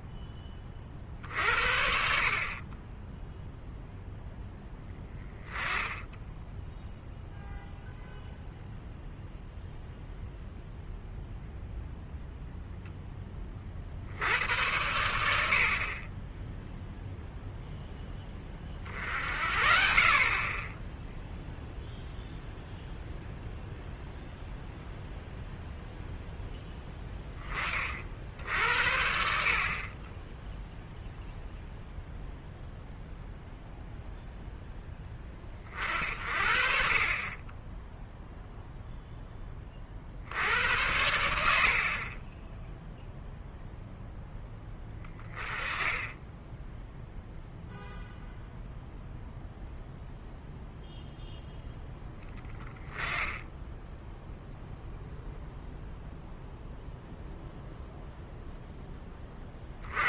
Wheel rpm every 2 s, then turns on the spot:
30, 30, 10, 0, 0, 0, 0, 100, 0, 30, 10, 0, 0, 10, 70, 0, 0, 0, 50, 0, 90, 0, 10, 10, 0, 0, 10, 0, 0, 10.
none